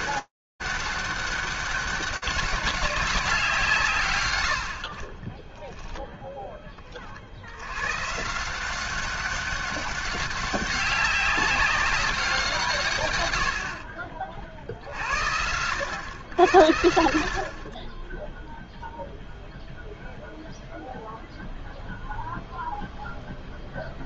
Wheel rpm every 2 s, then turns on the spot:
200, 120, 0, 150, 200, 190, 50, 100, 20, 0, 0, 0.
none